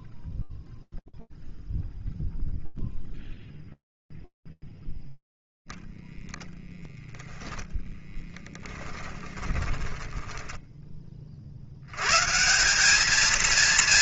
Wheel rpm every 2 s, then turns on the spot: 0, 0, 0, 0, 10, 40, 220.
8-10